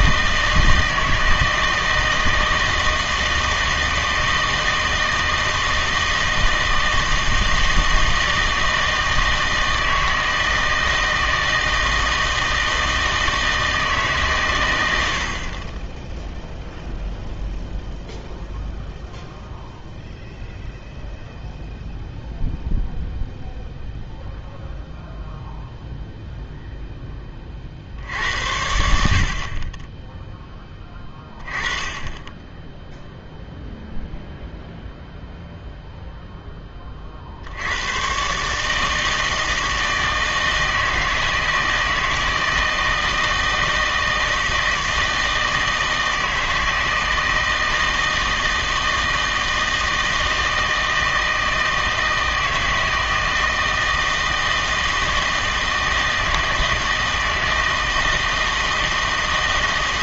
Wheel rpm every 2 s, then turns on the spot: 160, 160, 160, 160, 160, 160, 160, 100, 0, 0, 0, 0, 0, 0, 70, 10, 0, 0, 20, 160, 160, 160, 160, 160, 160, 160, 160, 160, 160, 160.
none